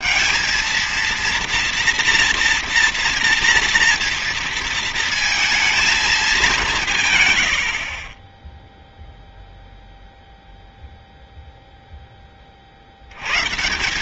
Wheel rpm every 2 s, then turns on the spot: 230, 240, 230, 150, 0, 0, 60.
none